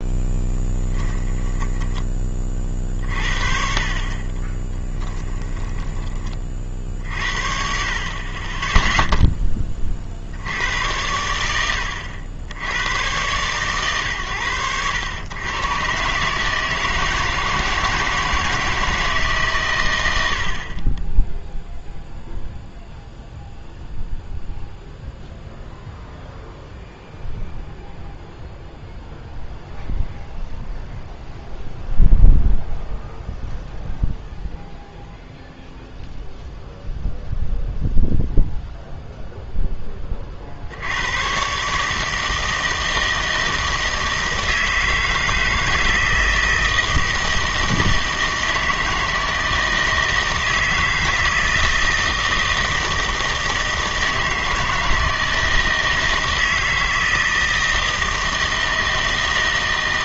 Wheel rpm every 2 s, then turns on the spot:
10, 40, 20, 50, 10, 90, 90, 100, 160, 160, 40, 0, 0, 0, 0, 0, 0, 0, 0, 0, 70, 160, 160, 160, 160, 160, 160, 160, 160, 160.
0-2 4-6